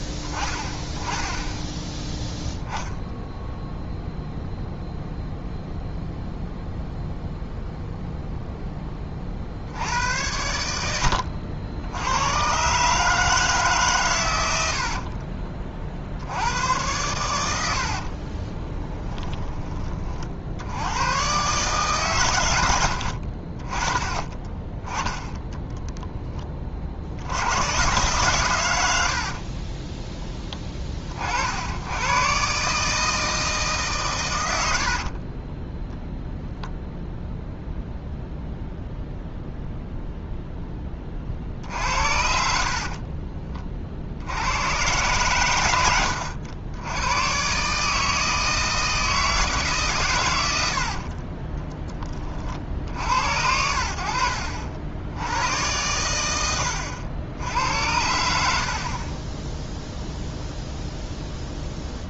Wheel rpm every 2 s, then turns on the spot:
10, 0, 0, 0, 10, 90, 140, 80, 90, 20, 90, 90, 20, 50, 100, 30, 140, 90, 0, 0, 10, 60, 110, 100, 160, 80, 50, 70, 90, 60, 0.
18-20 34-36 42-44 56-58